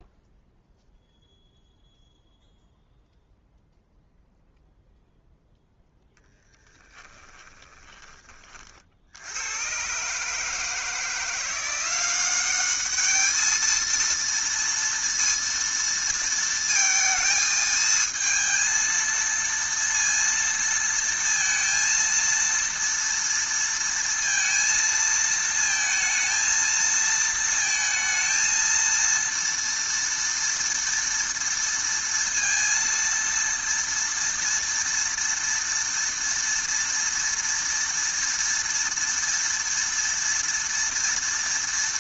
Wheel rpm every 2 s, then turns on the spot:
0, 0, 0, 10, 40, 160, 210, 230, 230, 230, 230, 230, 230, 220, 230, 230, 230, 230, 230, 230, 230.
6-8